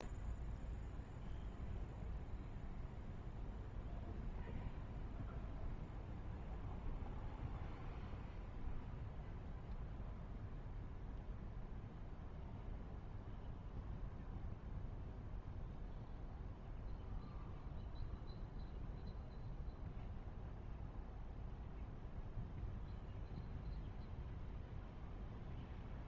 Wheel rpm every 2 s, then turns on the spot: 0, 0, 0, 0, 0, 0, 0, 0, 0, 0, 0, 0, 0.
none